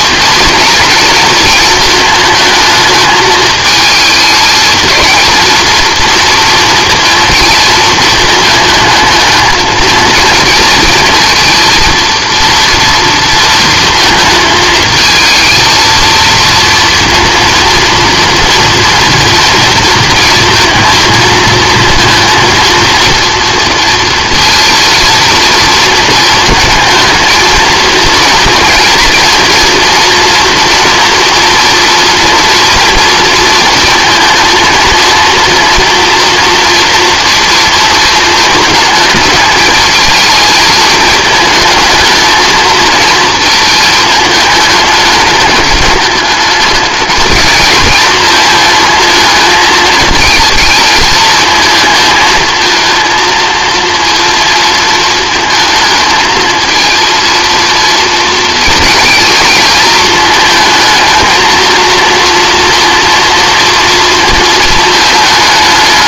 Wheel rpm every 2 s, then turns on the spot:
220, 220, 220, 230, 220, 230, 230, 220, 230, 230, 230, 230, 230, 220, 230, 230, 240, 220, 230, 210, 220, 230, 210, 210, 220, 220, 230, 230, 230, 230, 220, 230, 220.
none